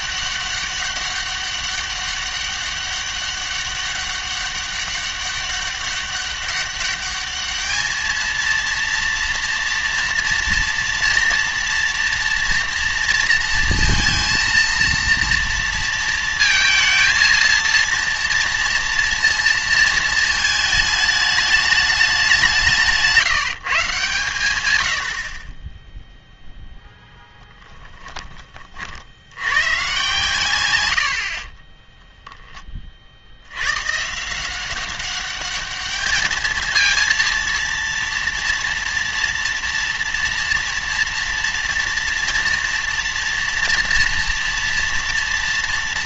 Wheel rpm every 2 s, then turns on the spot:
200, 200, 200, 200, 230, 230, 230, 230, 230, 230, 220, 170, 110, 0, 50, 90, 30, 190, 230, 230, 230, 230, 230.
none